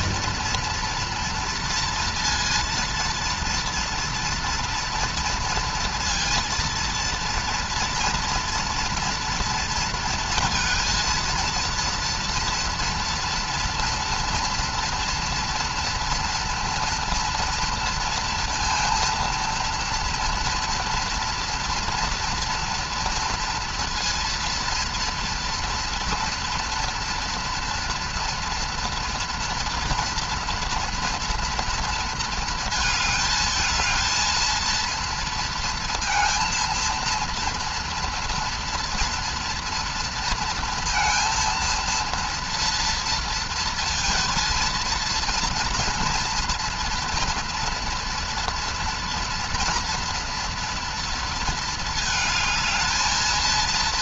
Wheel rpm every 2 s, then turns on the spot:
230, 230, 230, 230, 230, 230, 230, 230, 230, 230, 230, 230, 230, 230, 230, 240, 220, 230, 230, 230, 230, 230, 230, 230, 230, 230, 220.
none